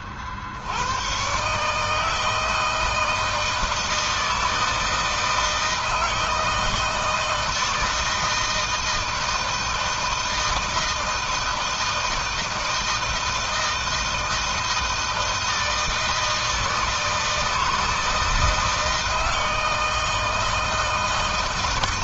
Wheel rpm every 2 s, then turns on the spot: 70, 160, 160, 160, 160, 160, 160, 160, 160, 160, 160.
none